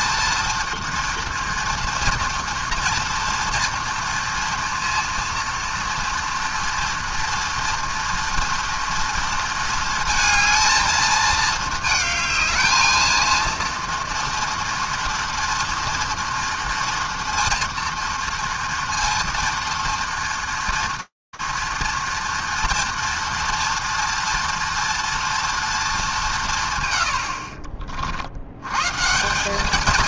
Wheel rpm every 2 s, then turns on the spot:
230, 230, 230, 230, 230, 230, 220, 230, 230, 230, 230, 230, 230, 120, 120.
none